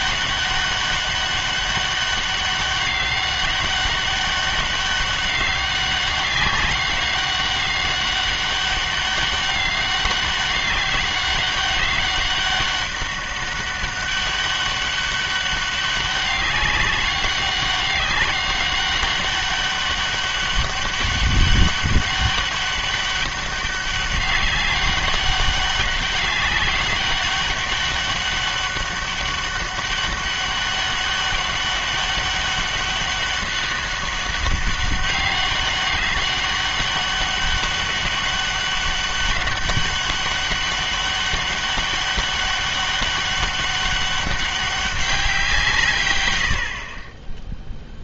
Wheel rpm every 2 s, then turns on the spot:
200, 200, 200, 190, 200, 200, 200, 200, 190, 200, 200, 200, 200, 200, 200, 200, 200, 200, 200, 200, 200, 200, 200, 70.
none